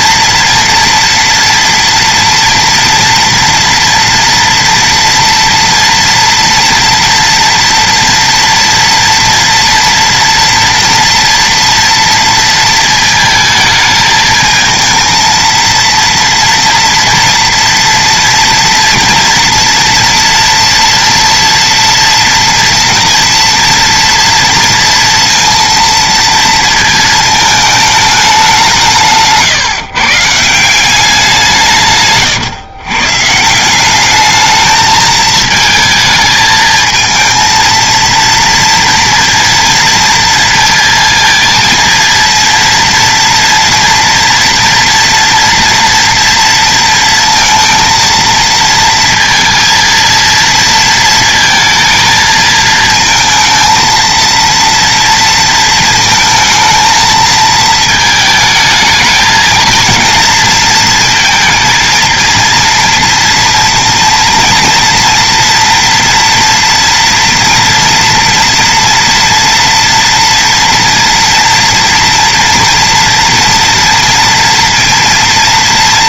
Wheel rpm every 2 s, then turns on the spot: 230, 240, 230, 230, 230, 230, 230, 220, 230, 230, 230, 230, 230, 230, 200, 150, 130, 210, 220, 230, 230, 230, 230, 230, 230, 230, 230, 230, 230, 220, 230, 230, 230, 230, 230, 230, 230, 230.
none